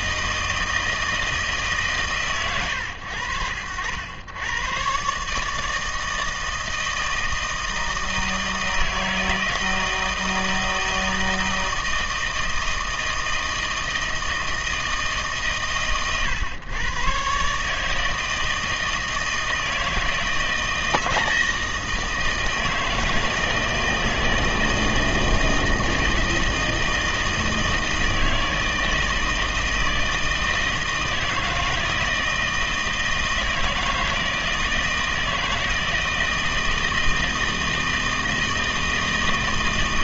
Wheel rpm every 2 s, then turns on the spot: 160, 100, 140, 160, 160, 160, 160, 150, 120, 160, 160, 160, 160, 160, 160, 160, 160, 160, 160, 160.
none